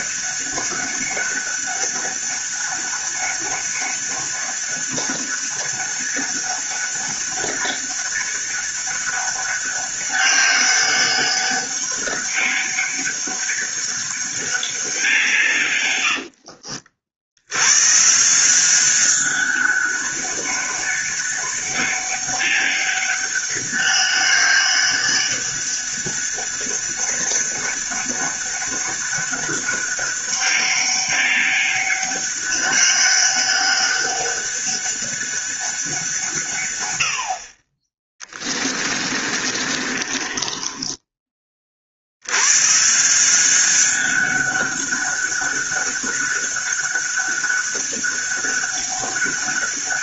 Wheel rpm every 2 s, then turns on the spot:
200, 200, 200, 200, 200, 200, 200, 190, 70, 190, 200, 200, 200, 200, 200, 200, 200, 200, 100, 30, 20, 140, 200, 200, 200.
38-42